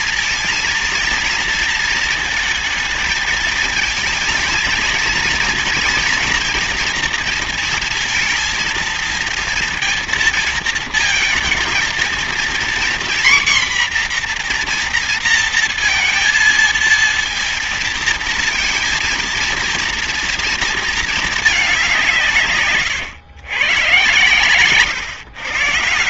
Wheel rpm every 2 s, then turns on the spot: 230, 220, 230, 230, 230, 230, 250, 240, 230, 230, 230, 120, 130.
none